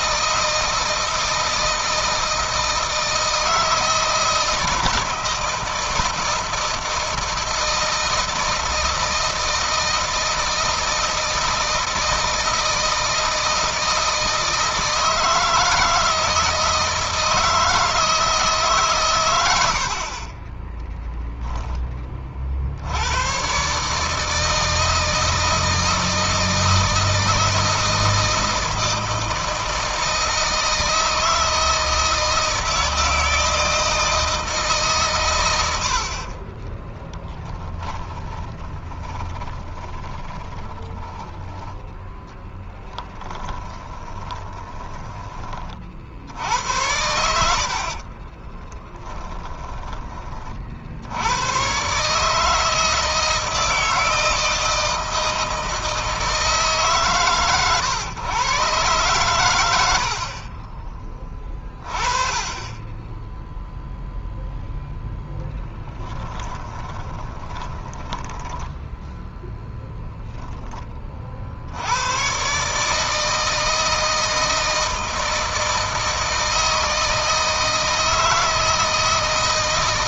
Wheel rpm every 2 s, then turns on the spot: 160, 160, 170, 160, 160, 160, 160, 160, 160, 130, 10, 90, 160, 160, 160, 160, 160, 130, 10, 30, 10, 10, 20, 80, 10, 70, 160, 160, 140, 120, 20, 10, 0, 20, 10, 30, 150, 160, 160, 160.
20-22 36-44 46-50 66-68